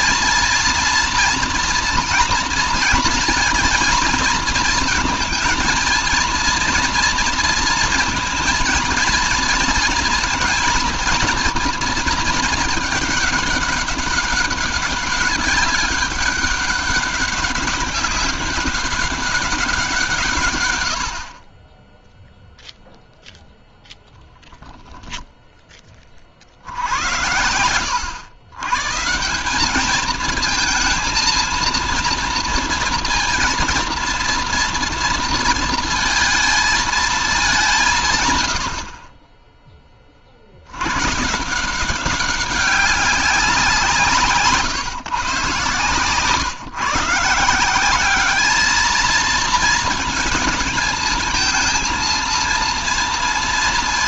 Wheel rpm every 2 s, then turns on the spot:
230, 230, 230, 230, 230, 230, 220, 200, 200, 200, 110, 0, 10, 70, 120, 220, 230, 230, 230, 90, 90, 200, 150, 130, 220, 220, 230.
none